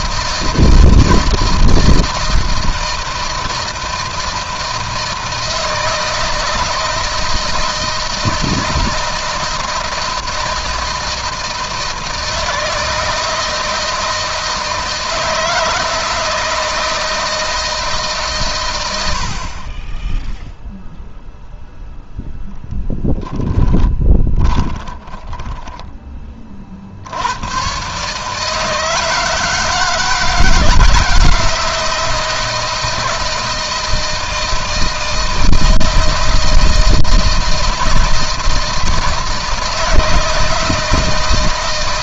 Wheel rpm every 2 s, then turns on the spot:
160, 160, 160, 160, 160, 160, 160, 160, 160, 120, 0, 0, 20, 60, 160, 170, 160, 160, 160, 160, 160.
24-26